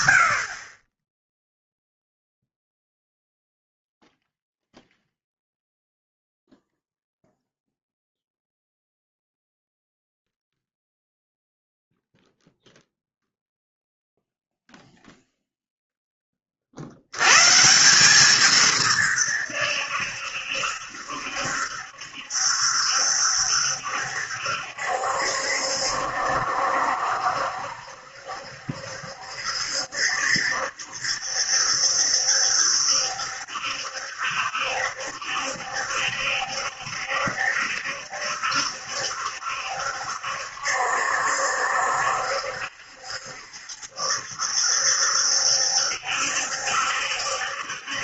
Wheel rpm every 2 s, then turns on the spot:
30, 0, 0, 0, 0, 0, 0, 0, 50, 150, 70, 70, 70, 70, 70, 70, 70, 70, 70, 70, 70, 70, 70, 70.
none